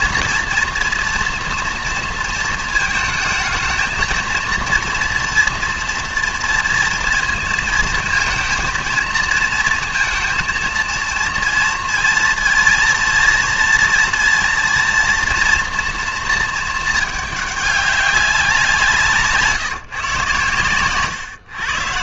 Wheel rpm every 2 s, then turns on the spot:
230, 220, 230, 230, 230, 230, 230, 230, 220, 180, 120.
none